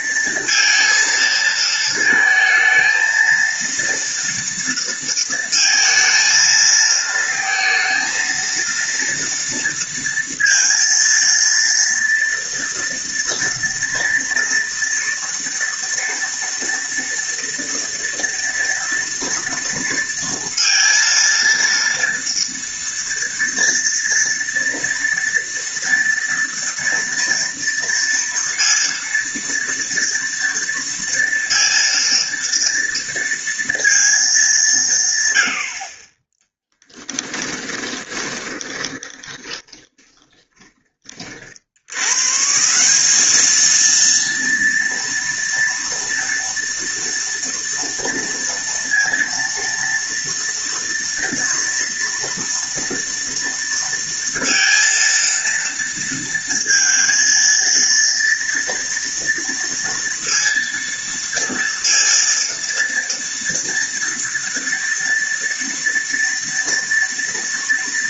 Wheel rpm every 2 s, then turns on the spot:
230, 220, 230, 220, 230, 230, 230, 230, 230, 230, 230, 230, 240, 230, 240, 230, 230, 160, 10, 30, 30, 180, 230, 230, 230, 230, 230, 230, 230, 230, 230, 230, 230, 230.
36-40